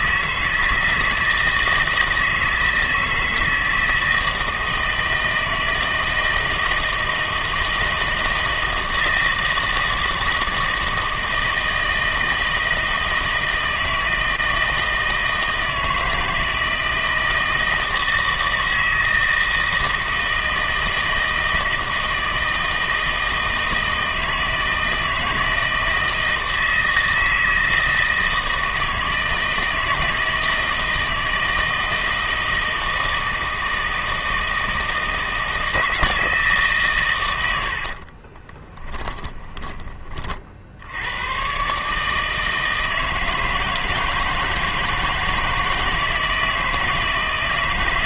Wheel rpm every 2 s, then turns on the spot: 160, 160, 160, 160, 160, 160, 160, 160, 160, 160, 160, 160, 160, 160, 160, 160, 160, 160, 140, 20, 80, 160, 160, 160.
38-40